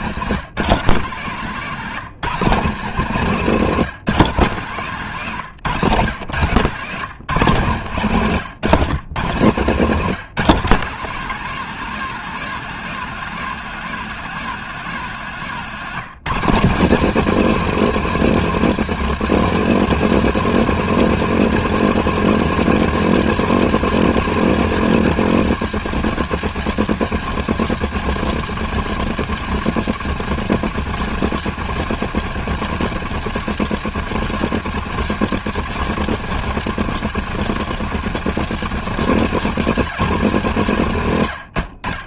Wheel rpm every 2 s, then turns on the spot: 160, 170, 150, 150, 130, 180, 210, 190, 200, 210, 220, 210, 210, 200, 190, 190, 190, 190, 190, 190, 140.
8-10